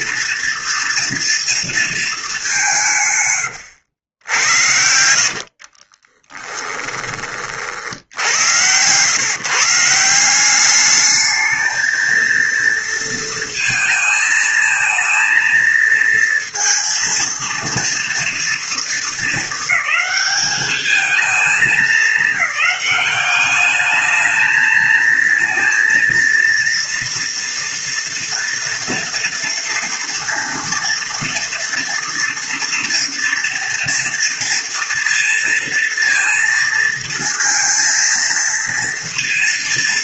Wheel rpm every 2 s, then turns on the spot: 240, 150, 70, 20, 120, 210, 230, 220, 230, 230, 210, 190, 220, 230, 230, 230, 230, 230, 230, 230.
4-6